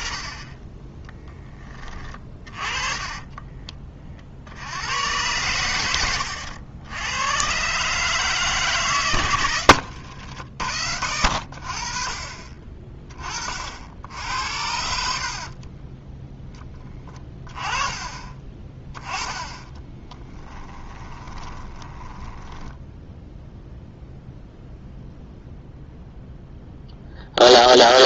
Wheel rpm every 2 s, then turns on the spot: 10, 30, 90, 90, 140, 60, 30, 60, 10, 20, 20, 10, 0, 0.
2-4 20-24